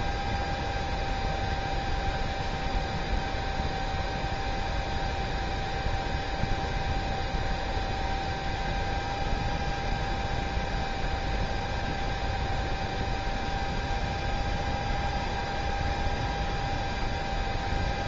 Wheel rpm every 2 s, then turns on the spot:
0, 0, 0, 0, 0, 0, 0, 0, 0.
none